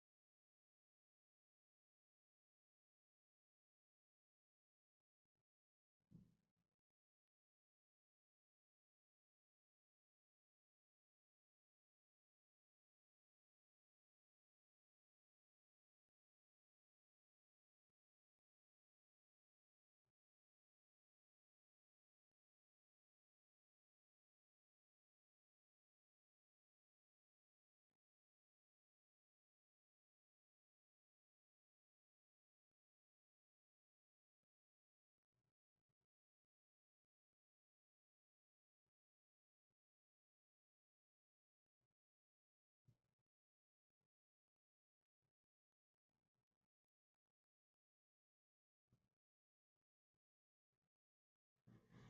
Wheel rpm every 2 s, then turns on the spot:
0, 0, 0, 0, 0, 0, 0, 0, 0, 0, 0, 0, 0, 0, 0, 0, 0, 0, 0, 0, 0, 0, 0, 0, 0, 0.
none